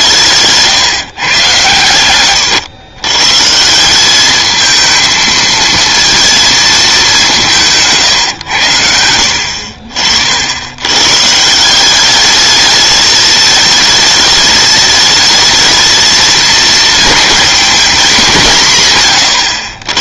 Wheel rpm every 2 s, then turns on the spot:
150, 120, 220, 210, 80, 100, 210, 220, 220, 150.
none